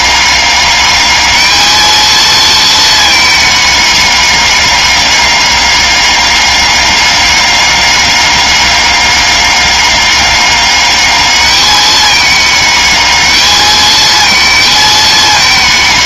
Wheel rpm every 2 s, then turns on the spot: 200, 220, 200, 200, 200, 200, 210, 220.
none